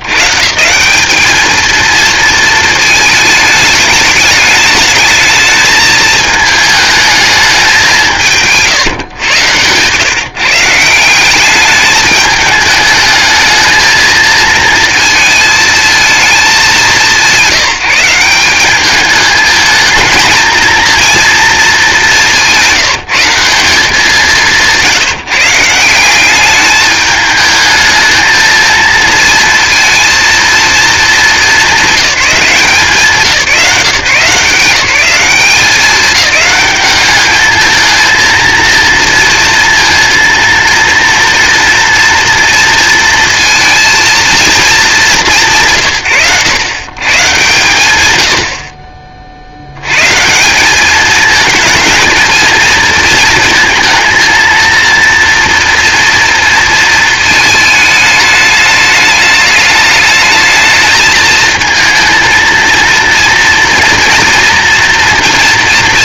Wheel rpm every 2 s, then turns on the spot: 130, 220, 210, 220, 140, 160, 210, 220, 170, 200, 230, 180, 170, 210, 220, 230, 170, 180, 210, 230, 230, 230, 230, 140, 50, 200, 220, 230, 230, 210, 220, 230, 230.
none